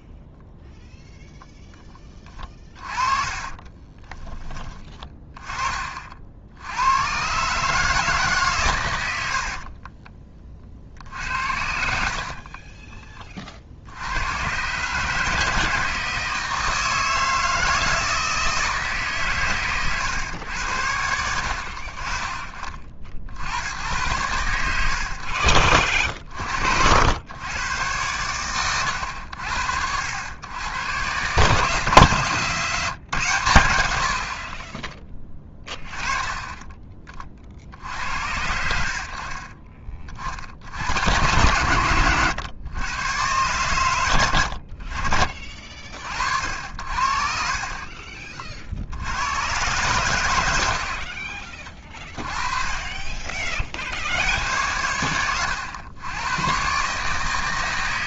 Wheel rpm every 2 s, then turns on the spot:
0, 30, 20, 80, 120, 40, 30, 130, 160, 160, 100, 50, 100, 60, 100, 100, 150, 40, 40, 70, 70, 110, 70, 60, 50, 80, 20, 90, 120.
2-4 12-14 44-46 50-52